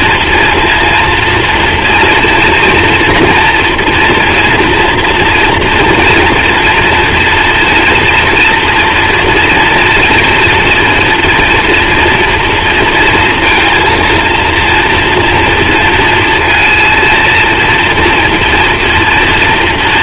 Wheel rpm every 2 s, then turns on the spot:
230, 230, 230, 230, 240, 230, 230, 230, 230, 230.
none